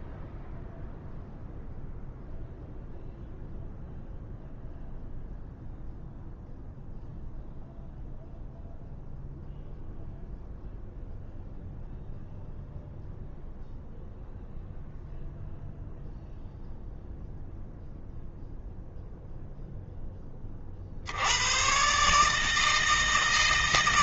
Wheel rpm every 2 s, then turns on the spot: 0, 0, 0, 0, 0, 0, 0, 0, 0, 0, 50, 160.
none